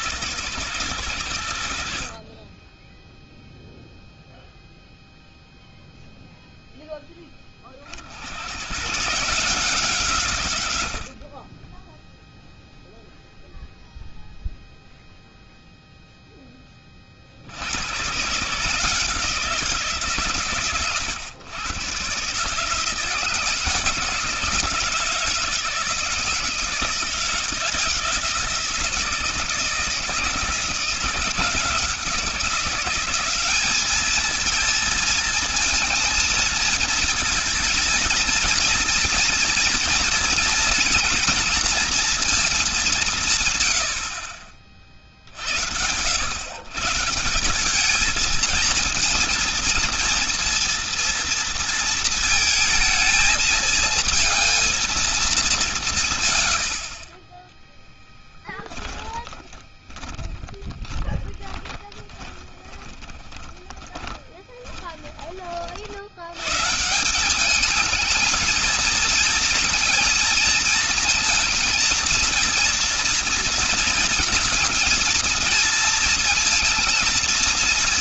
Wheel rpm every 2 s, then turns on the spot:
110, 20, 0, 0, 110, 100, 0, 0, 10, 150, 130, 150, 160, 160, 160, 160, 180, 220, 230, 230, 230, 200, 50, 140, 220, 230, 220, 220, 70, 10, 10, 20, 20, 130, 230, 230, 230, 220, 230.
58-66